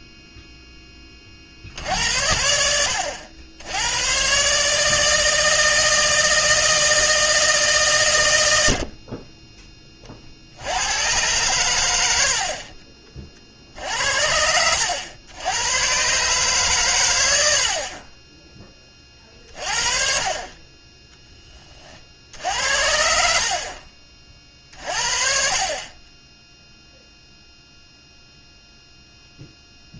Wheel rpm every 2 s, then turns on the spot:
0, 70, 140, 160, 90, 70, 60, 70, 140, 10, 30, 70, 40, 0, 0.
none